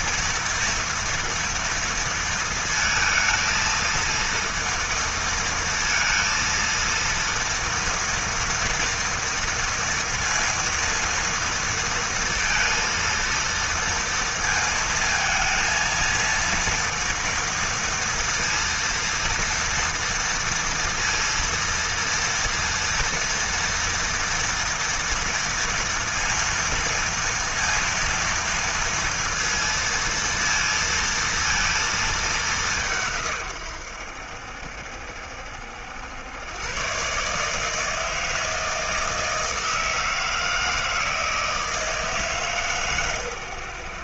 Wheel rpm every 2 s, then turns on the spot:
240, 220, 230, 230, 230, 230, 230, 230, 230, 230, 230, 230, 230, 230, 230, 230, 150, 70, 140, 160, 160, 120.
none